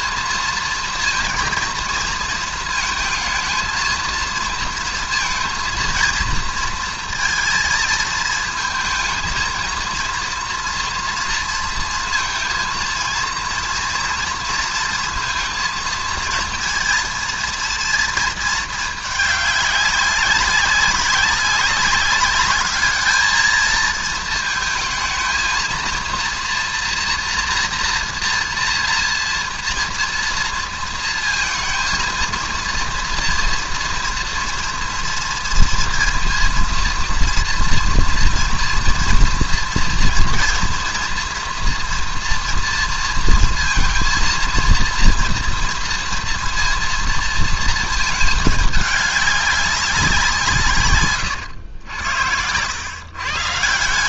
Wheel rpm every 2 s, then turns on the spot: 230, 220, 230, 230, 220, 230, 230, 230, 230, 220, 190, 210, 230, 240, 230, 230, 230, 230, 230, 230, 230, 230, 230, 230, 210, 160, 90.
none